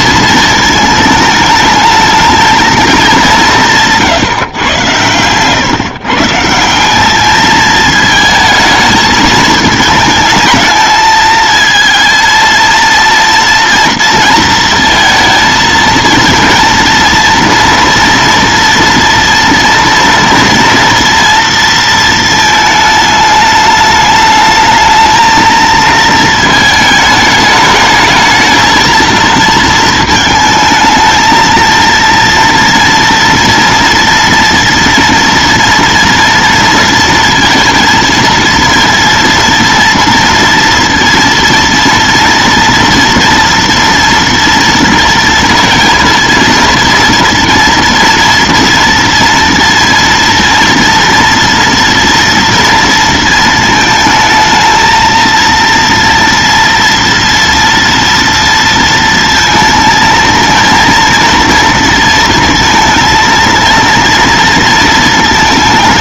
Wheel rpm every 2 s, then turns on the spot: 220, 220, 120, 170, 220, 220, 230, 230, 230, 230, 230, 220, 220, 220, 220, 220, 230, 240, 230, 230, 230, 230, 230, 230, 230, 230, 230, 220, 230, 230, 230, 230, 230.
none